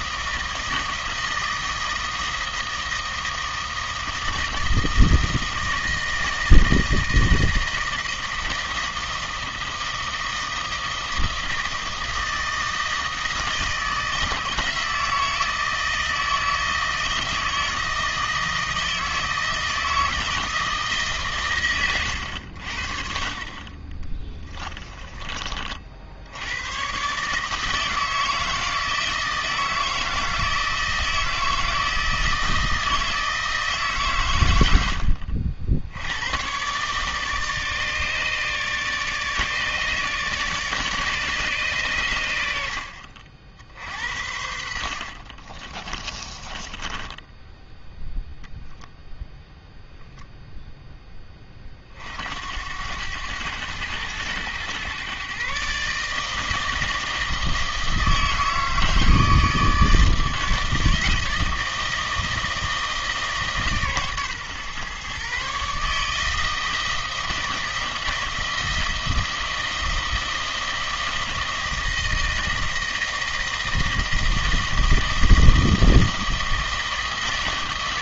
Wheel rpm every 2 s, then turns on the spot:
160, 160, 160, 160, 160, 160, 160, 160, 160, 160, 160, 70, 20, 100, 160, 160, 160, 100, 120, 150, 150, 70, 60, 20, 0, 0, 80, 110, 160, 160, 160, 160, 130, 160, 160, 160, 160, 160, 160.
24-26 46-48